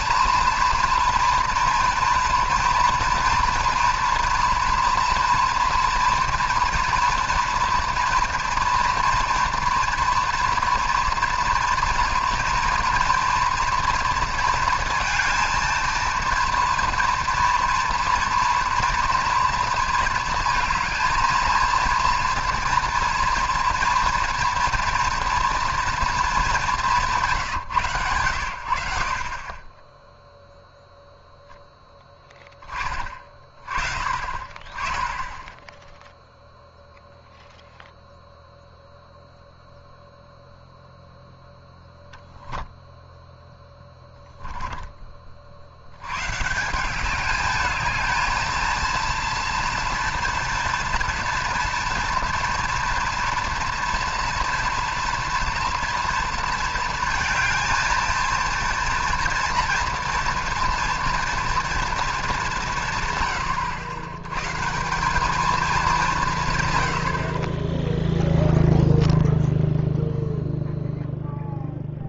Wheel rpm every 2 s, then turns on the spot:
230, 240, 230, 240, 230, 230, 240, 230, 230, 230, 230, 230, 230, 190, 80, 0, 20, 30, 0, 0, 0, 0, 10, 170, 230, 230, 230, 230, 230, 230, 240, 180, 150, 110, 0, 0.
44-46